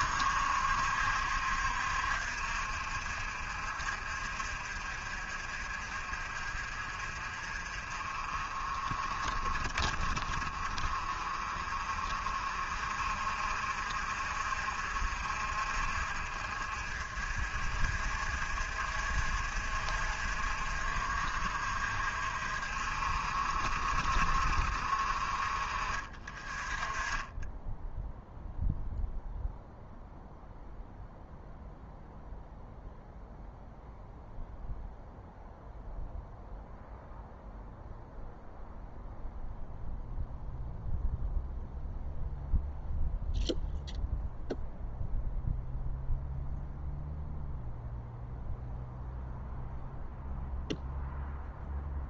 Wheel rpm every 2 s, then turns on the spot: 70, 60, 50, 50, 40, 40, 50, 50, 50, 50, 50, 50, 50, 30, 0, 0, 0, 0, 0, 0, 0, 0, 0, 0, 0, 0.
none